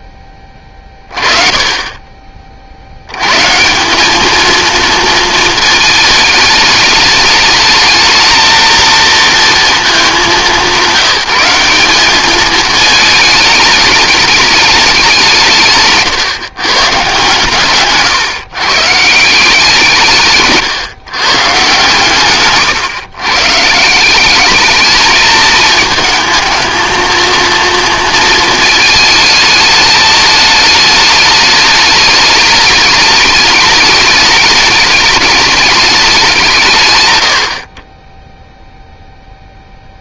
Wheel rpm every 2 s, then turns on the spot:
20, 120, 230, 210, 230, 170, 210, 190, 130, 160, 130, 130, 220, 230, 220, 210, 210, 210, 100, 0.
none